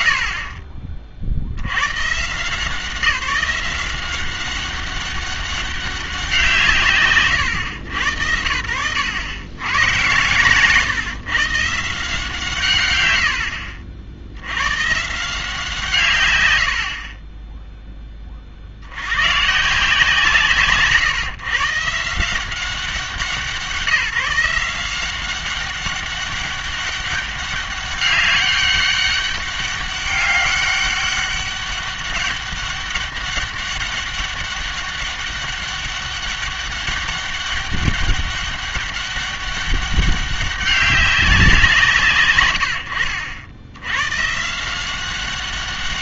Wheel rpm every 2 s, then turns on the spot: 70, 160, 190, 170, 80, 130, 150, 100, 100, 40, 140, 180, 170, 200, 200, 200, 200, 200, 200, 200, 200, 110, 160.
none